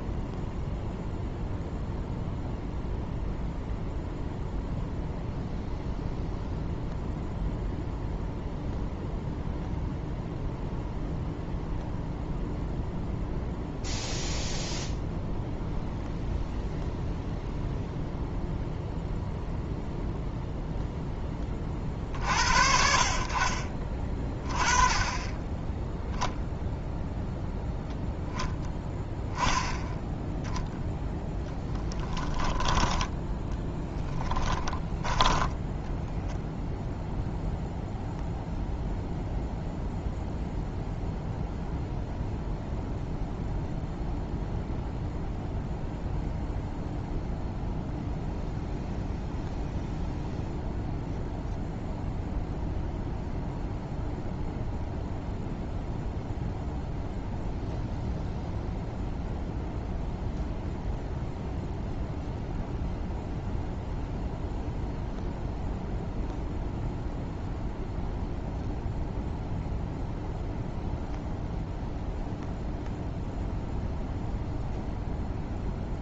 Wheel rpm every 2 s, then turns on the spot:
0, 0, 0, 0, 0, 0, 0, 0, 0, 0, 0, 60, 20, 0, 10, 0, 10, 10, 0, 0, 0, 0, 0, 0, 0, 0, 0, 0, 0, 0, 0, 0, 0, 0, 0, 0, 0, 0.
34-36